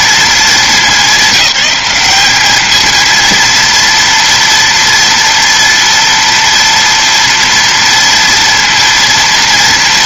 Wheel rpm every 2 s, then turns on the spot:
210, 220, 240, 230, 240.
none